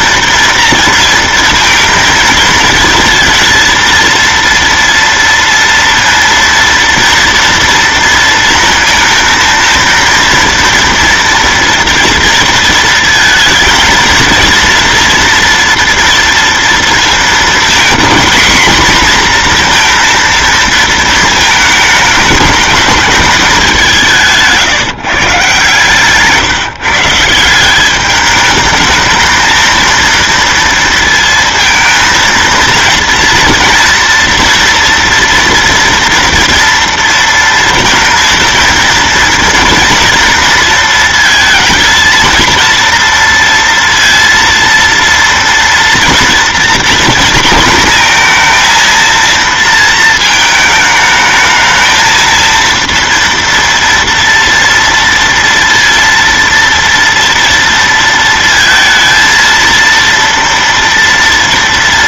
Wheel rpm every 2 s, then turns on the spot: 230, 230, 230, 230, 230, 230, 230, 230, 230, 240, 230, 210, 160, 140, 210, 230, 230, 230, 230, 230, 230, 230, 230, 240, 230, 220, 230, 230, 230, 230, 230.
none